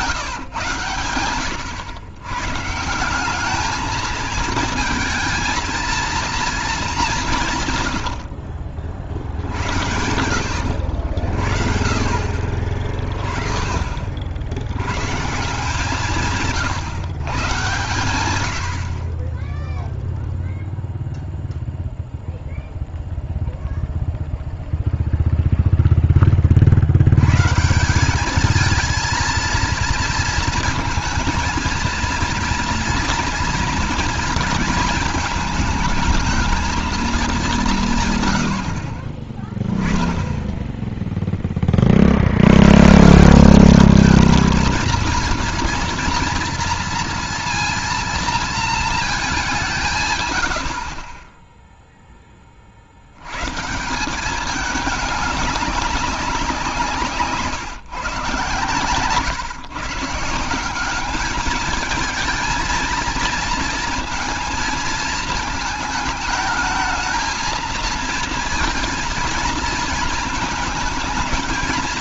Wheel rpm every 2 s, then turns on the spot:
120, 160, 220, 210, 70, 80, 30, 110, 140, 60, 0, 0, 0, 70, 220, 220, 230, 220, 220, 40, 0, 140, 230, 230, 220, 50, 50, 200, 160, 140, 190, 230, 220, 220, 230, 220.
none